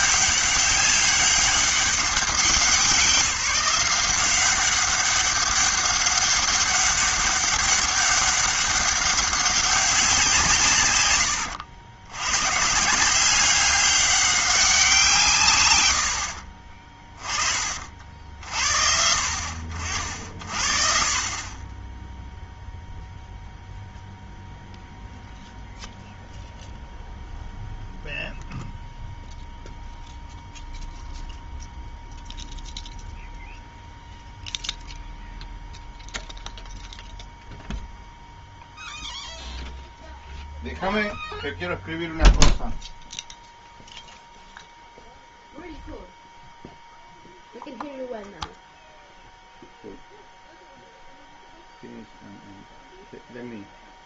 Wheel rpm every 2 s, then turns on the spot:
200, 190, 190, 200, 200, 150, 140, 190, 50, 60, 50, 0, 0, 0, 0, 0, 0, 0, 0, 0, 0, 0, 0, 0, 0, 0, 0.
16-18